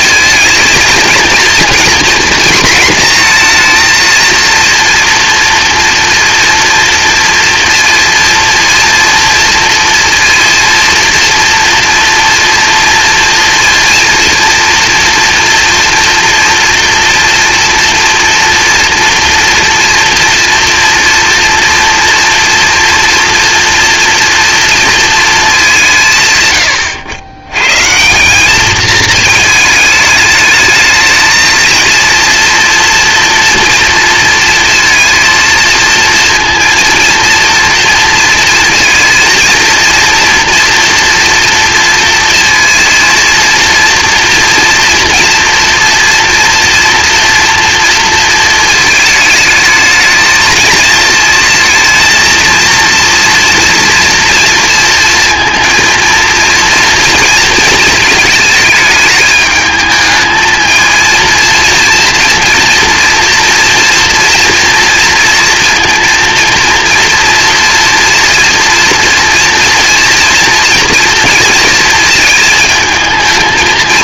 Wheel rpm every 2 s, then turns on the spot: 230, 230, 230, 230, 230, 230, 230, 230, 230, 230, 240, 230, 230, 100, 210, 220, 230, 230, 230, 230, 230, 230, 230, 230, 220, 220, 230, 230, 230, 220, 220, 240, 230, 230, 230, 230, 220.
none